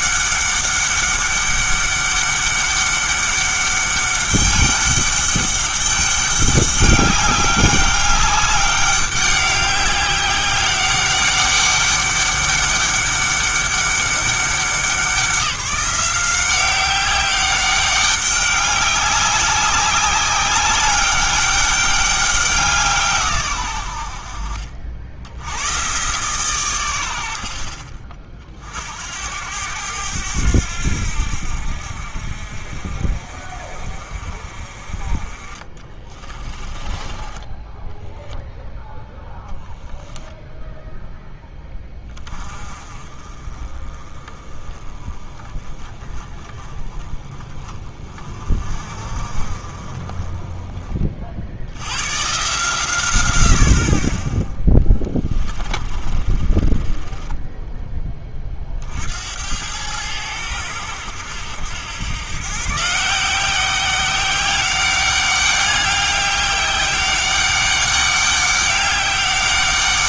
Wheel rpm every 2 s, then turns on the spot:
200, 200, 200, 200, 200, 200, 200, 190, 190, 200, 200, 180, 60, 110, 60, 80, 50, 40, 20, 0, 10, 30, 20, 20, 40, 30, 140, 20, 30, 40, 90, 140, 190, 200, 200.
36-38 54-58